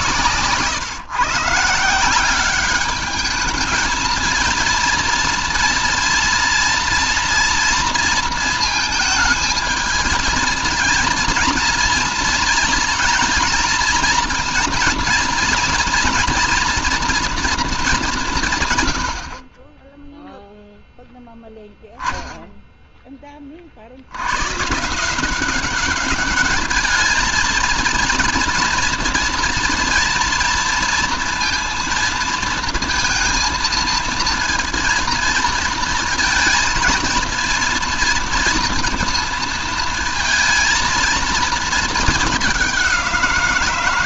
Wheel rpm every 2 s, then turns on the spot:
130, 200, 230, 240, 220, 220, 230, 230, 240, 140, 0, 10, 120, 210, 230, 230, 230, 230, 230, 230, 230, 200.
none